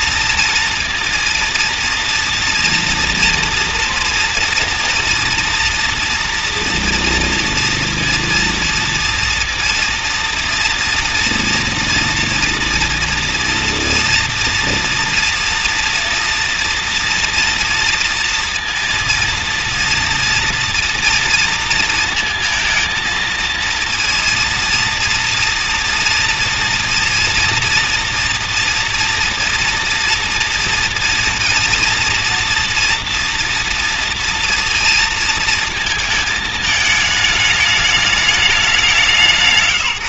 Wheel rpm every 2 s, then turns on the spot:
230, 230, 230, 230, 230, 230, 230, 230, 230, 230, 230, 230, 240, 240, 230, 230, 230, 230, 220, 200.
none